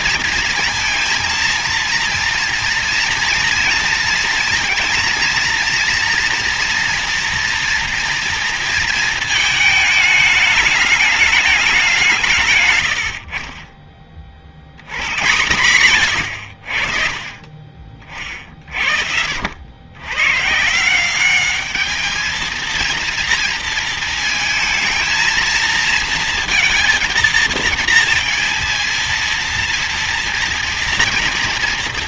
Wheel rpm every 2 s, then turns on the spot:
230, 230, 230, 230, 230, 210, 160, 60, 100, 40, 130, 220, 230, 230, 230, 230.
18-20